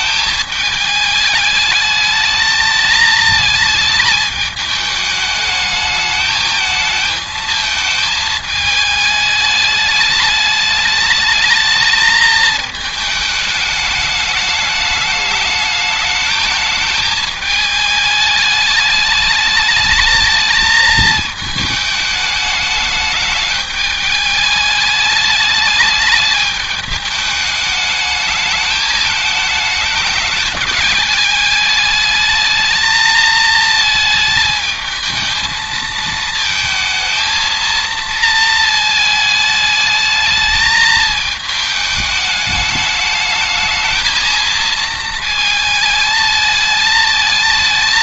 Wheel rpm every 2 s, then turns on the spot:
210, 220, 210, 220, 210, 220, 210, 210, 210, 220, 210, 210, 210, 210, 220, 210, 220, 220, 230, 220, 210, 220, 220, 220.
none